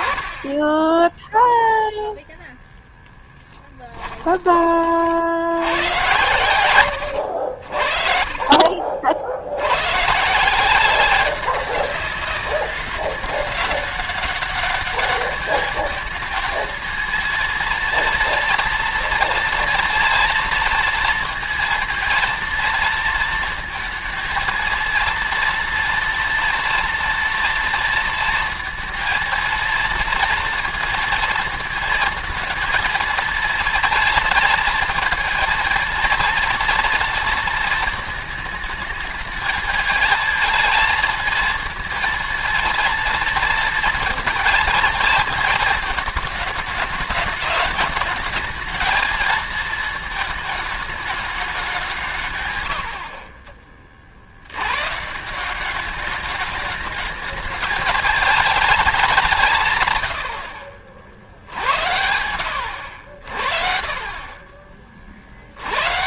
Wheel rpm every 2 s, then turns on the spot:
10, 0, 30, 100, 50, 170, 200, 200, 220, 230, 230, 230, 230, 230, 230, 230, 230, 230, 230, 220, 220, 230, 230, 220, 220, 220, 90, 110, 210, 210, 60, 60, 30.
none